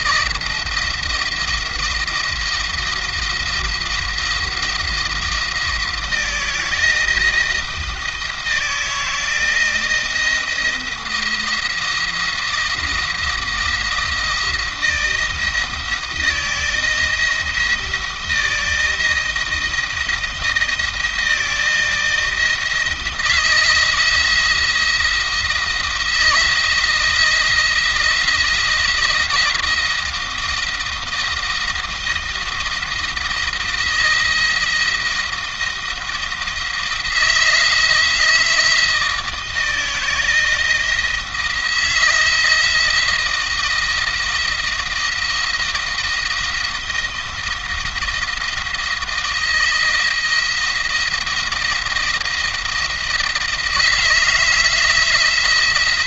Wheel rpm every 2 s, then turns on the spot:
170, 170, 170, 160, 160, 170, 170, 170, 170, 170, 160, 160, 160, 160, 170, 160, 160, 170, 170, 160, 170, 170, 170, 170, 160, 170, 160, 160.
none